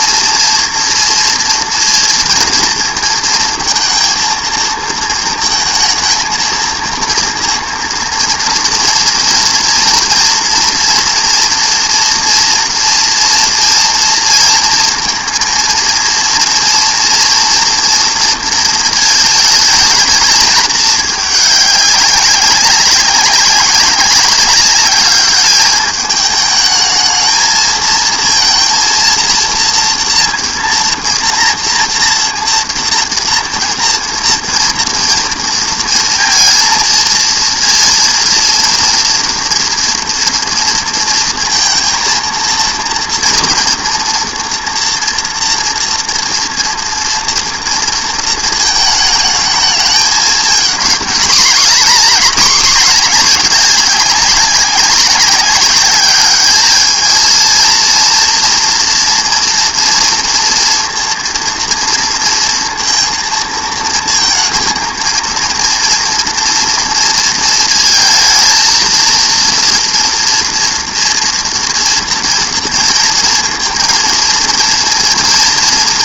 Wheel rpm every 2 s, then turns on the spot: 230, 220, 230, 230, 230, 240, 230, 230, 240, 230, 220, 200, 200, 210, 230, 230, 230, 230, 230, 230, 230, 230, 230, 230, 220, 220, 220, 200, 220, 240, 230, 230, 230, 230, 230, 230, 230, 230.
none